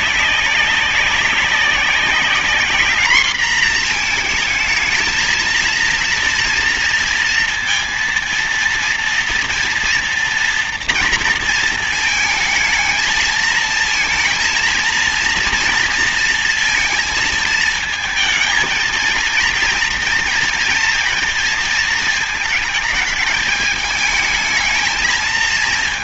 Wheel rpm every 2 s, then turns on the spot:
200, 200, 230, 230, 230, 230, 220, 230, 230, 220, 230, 230, 220.
none